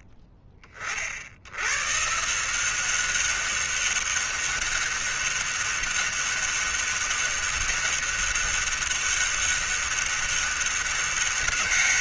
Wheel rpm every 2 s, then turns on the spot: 40, 180, 200, 200, 200, 200.
none